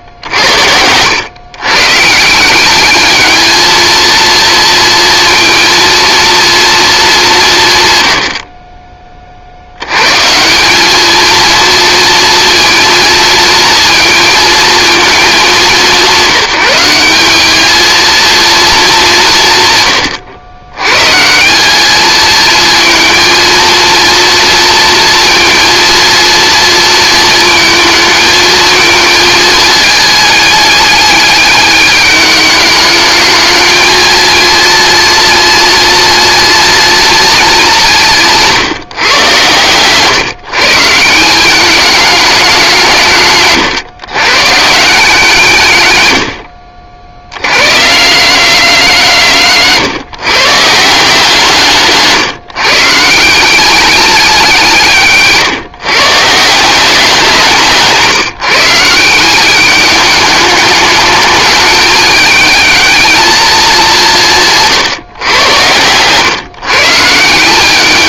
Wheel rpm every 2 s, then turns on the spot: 90, 190, 230, 230, 50, 180, 230, 220, 180, 220, 110, 220, 230, 230, 220, 210, 210, 230, 230, 170, 150, 180, 160, 60, 170, 160, 150, 170, 170, 160, 210, 220, 150, 140.
64-66